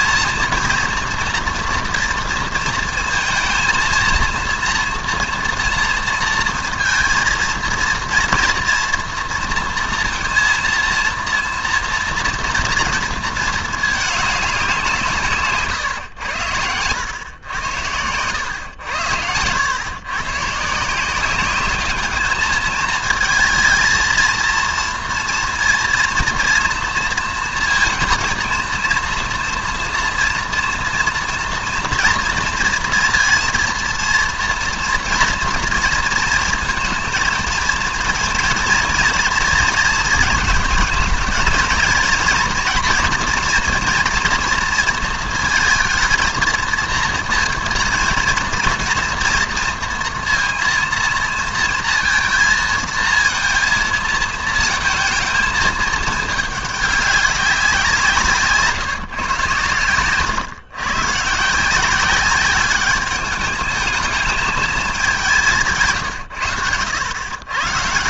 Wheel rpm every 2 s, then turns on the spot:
230, 230, 230, 230, 230, 230, 230, 190, 100, 100, 150, 220, 230, 230, 230, 230, 230, 230, 220, 230, 220, 230, 230, 220, 230, 230, 220, 220, 210, 150, 130, 200, 210, 100.
16-18